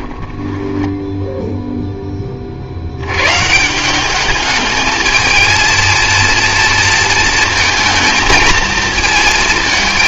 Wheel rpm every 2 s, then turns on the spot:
10, 50, 210, 230, 220.
0-2